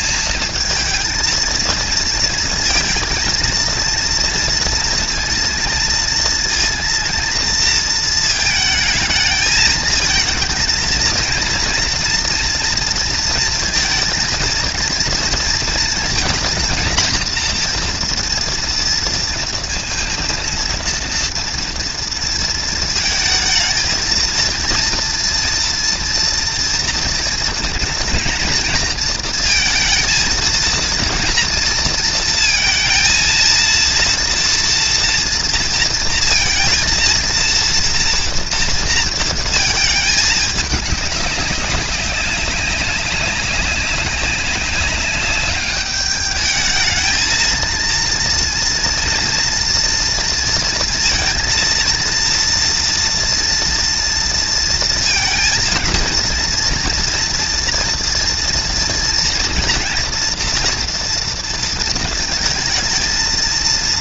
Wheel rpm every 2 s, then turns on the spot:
220, 230, 230, 230, 220, 230, 230, 230, 230, 230, 230, 220, 230, 230, 230, 230, 230, 230, 230, 220, 200, 200, 200, 220, 230, 230, 230, 230, 230, 230, 240, 220.
none